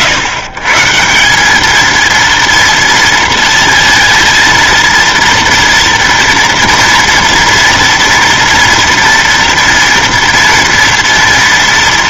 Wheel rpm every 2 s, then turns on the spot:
130, 230, 230, 230, 240, 240.
none